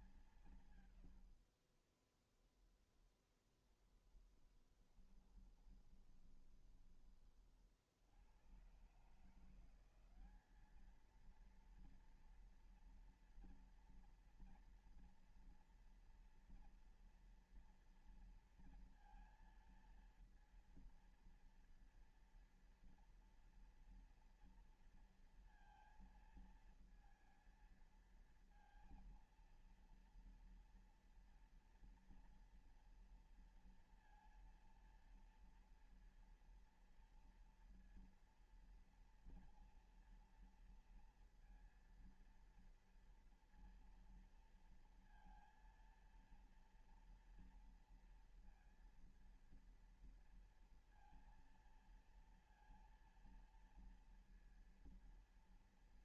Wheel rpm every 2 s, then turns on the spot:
160, 10, 20, 30, 130, 210, 230, 230, 230, 240, 230, 230, 240, 230, 230, 230, 230, 230, 230, 230, 230, 230, 230, 230, 230, 230, 230, 230.
2-6